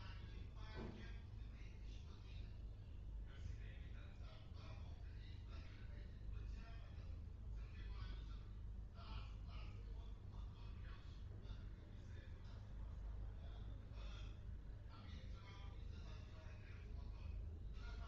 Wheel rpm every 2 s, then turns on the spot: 0, 0, 0, 0, 0, 0, 0, 0, 0.
none